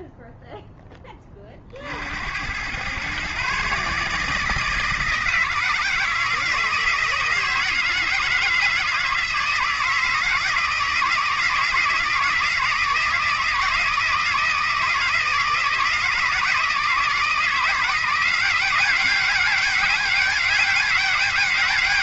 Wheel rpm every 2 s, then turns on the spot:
20, 130, 160, 170, 160, 160, 160, 160, 160, 190, 190.
none